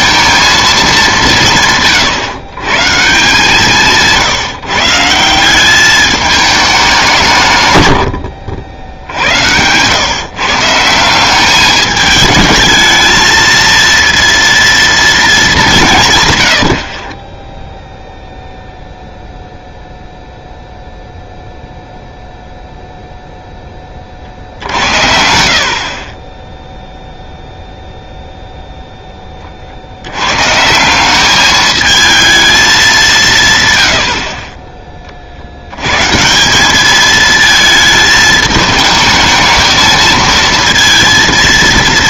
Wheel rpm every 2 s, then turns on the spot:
220, 140, 160, 200, 70, 160, 210, 230, 90, 0, 0, 0, 70, 10, 0, 160, 210, 30, 190, 210, 230.
none